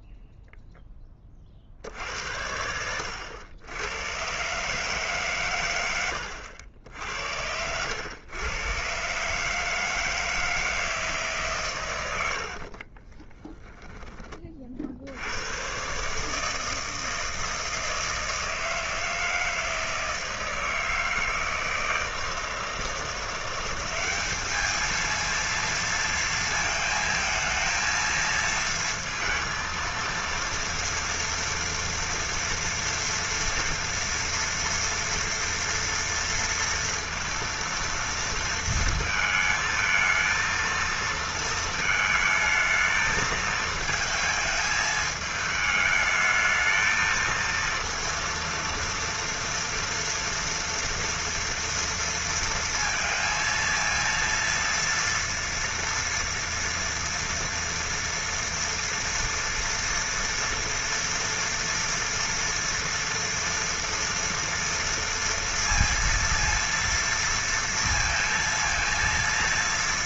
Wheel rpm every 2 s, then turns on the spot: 0, 70, 120, 90, 100, 160, 100, 20, 150, 160, 160, 160, 200, 230, 230, 230, 230, 230, 230, 230, 230, 220, 220, 220, 230, 230, 230, 230, 230, 230, 230, 230, 230, 230, 230.
6-8